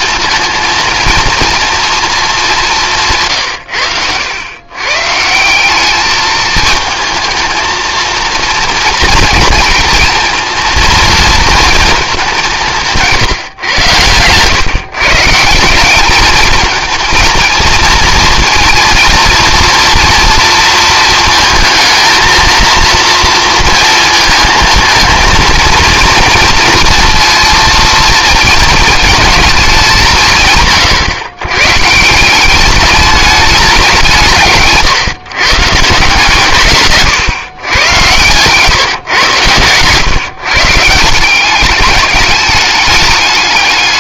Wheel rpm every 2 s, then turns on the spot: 230, 210, 120, 220, 230, 230, 180, 130, 220, 230, 230, 230, 230, 230, 220, 140, 200, 150, 150, 130, 140, 210.
38-40